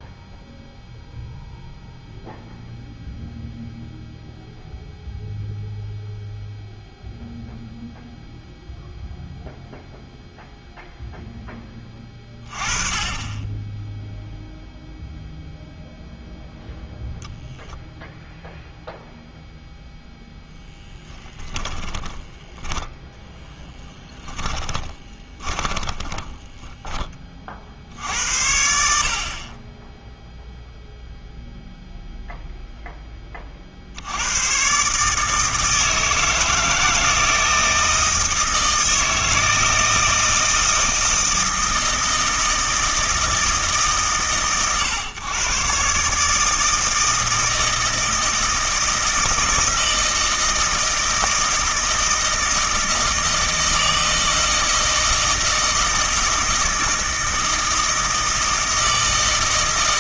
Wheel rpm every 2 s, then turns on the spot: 0, 0, 0, 0, 0, 0, 20, 0, 0, 0, 0, 20, 20, 10, 70, 0, 0, 130, 160, 160, 160, 160, 130, 160, 160, 160, 160, 160, 160, 160.
22-26